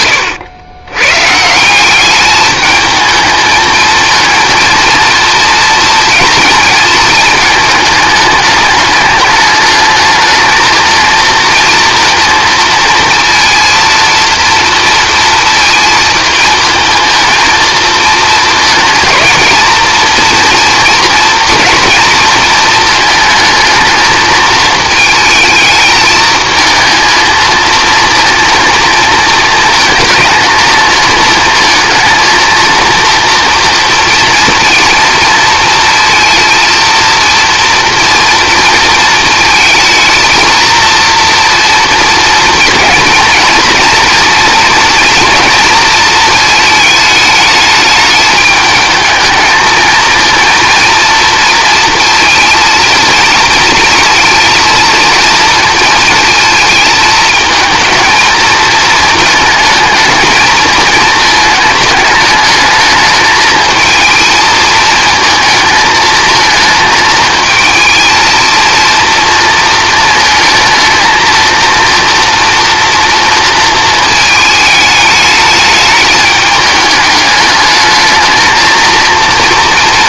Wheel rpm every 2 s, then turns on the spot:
110, 210, 230, 230, 210, 220, 230, 230, 230, 220, 230, 230, 220, 220, 230, 220, 230, 230, 230, 230, 230, 230, 230, 220, 220, 230, 230, 230, 220, 230, 220, 220, 230, 220, 230, 220, 230, 210, 210, 230.
none